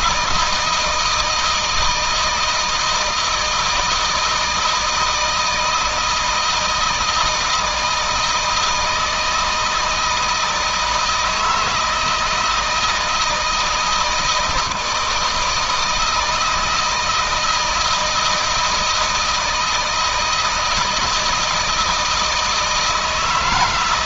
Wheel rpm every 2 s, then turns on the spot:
160, 160, 160, 160, 160, 160, 160, 160, 160, 170, 160, 160.
none